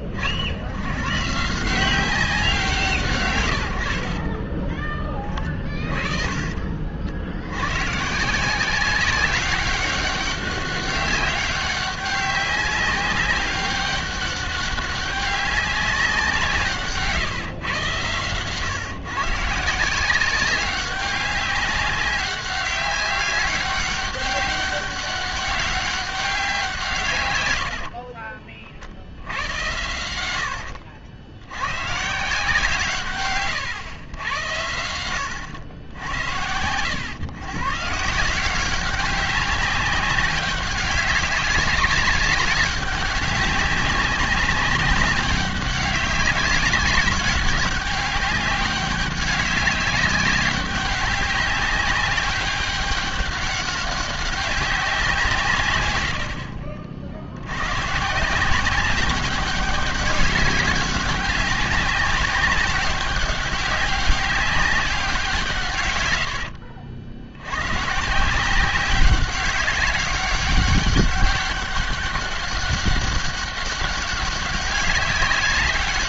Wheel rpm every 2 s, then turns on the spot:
70, 140, 30, 50, 190, 190, 200, 200, 140, 130, 190, 200, 190, 150, 60, 60, 150, 90, 110, 190, 200, 200, 190, 200, 200, 200, 200, 190, 60, 190, 190, 190, 200, 70, 190, 200, 200, 190.
16-18